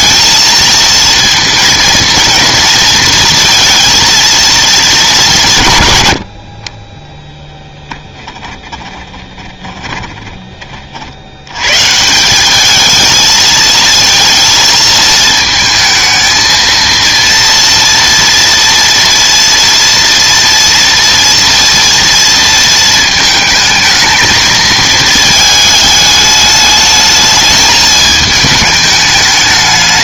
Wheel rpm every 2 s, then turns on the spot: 220, 230, 220, 30, 20, 40, 210, 220, 230, 230, 230, 220, 220, 210, 210.
8-10